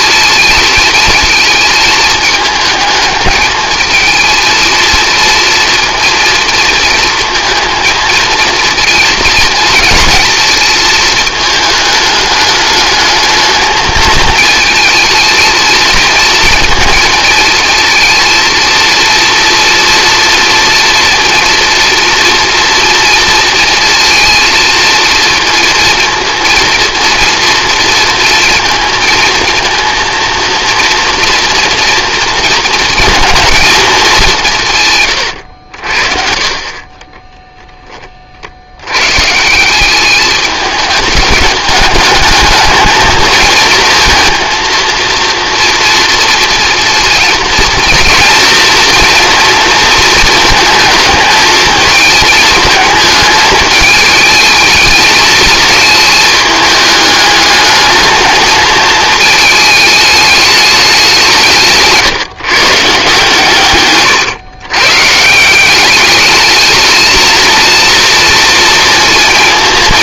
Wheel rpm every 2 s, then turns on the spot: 220, 220, 230, 230, 230, 220, 220, 220, 230, 230, 230, 230, 230, 230, 230, 230, 230, 130, 30, 100, 210, 220, 230, 230, 230, 220, 220, 220, 210, 220, 190, 150, 130, 220, 230.
none